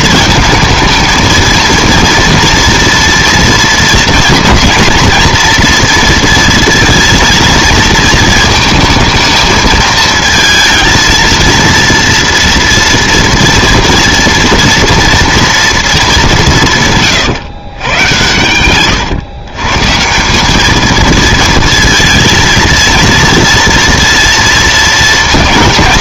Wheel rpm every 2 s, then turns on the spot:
220, 230, 230, 230, 230, 230, 230, 230, 150, 120, 200, 230, 230.
18-20